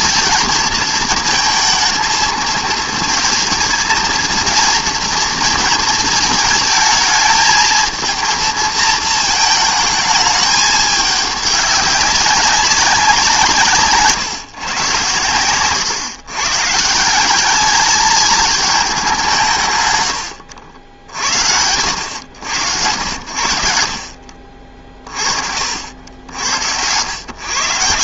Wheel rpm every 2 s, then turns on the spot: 230, 220, 230, 220, 230, 210, 190, 120, 150, 210, 70, 90, 40, 100.
none